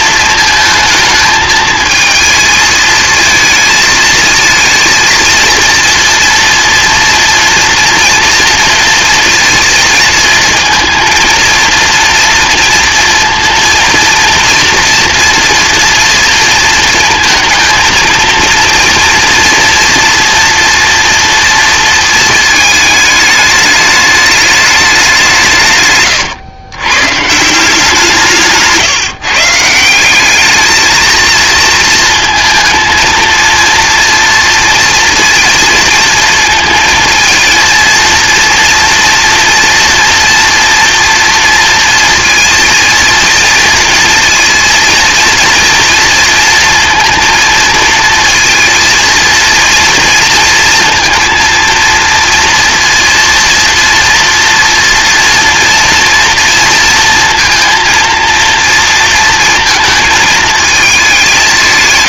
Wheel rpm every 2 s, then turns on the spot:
220, 220, 230, 230, 230, 230, 230, 230, 230, 230, 230, 220, 200, 130, 150, 220, 220, 230, 230, 230, 230, 230, 230, 230, 230, 230, 230, 240, 230, 230, 210.
none